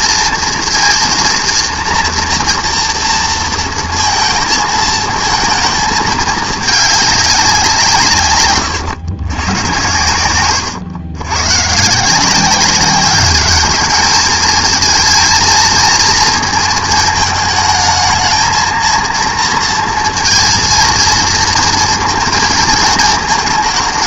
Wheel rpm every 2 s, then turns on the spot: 230, 230, 220, 210, 110, 100, 190, 220, 220, 230, 230, 220.
none